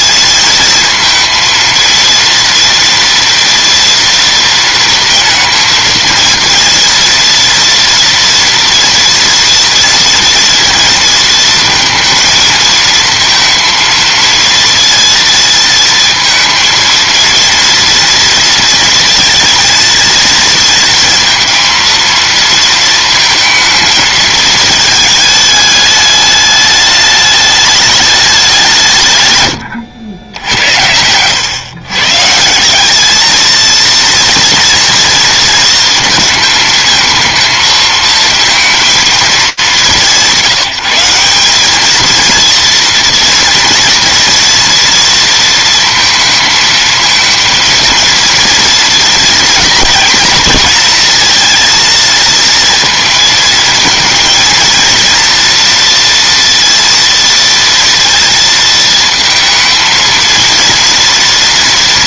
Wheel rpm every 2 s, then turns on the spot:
230, 230, 230, 230, 230, 230, 230, 230, 230, 230, 230, 230, 220, 210, 160, 90, 190, 230, 220, 230, 170, 230, 230, 230, 230, 230, 230, 230, 230, 230, 230.
none